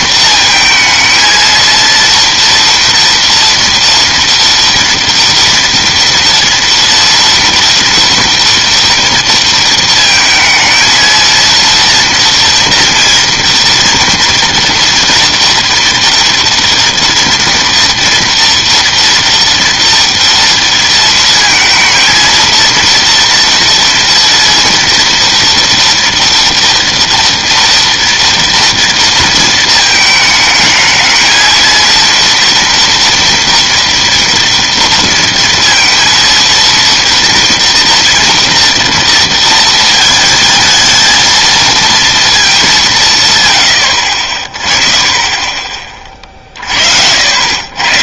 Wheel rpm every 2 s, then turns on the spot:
220, 230, 230, 240, 230, 230, 230, 240, 230, 230, 230, 230, 230, 230, 230, 220, 230, 230, 230, 230, 220, 200, 30, 50.
none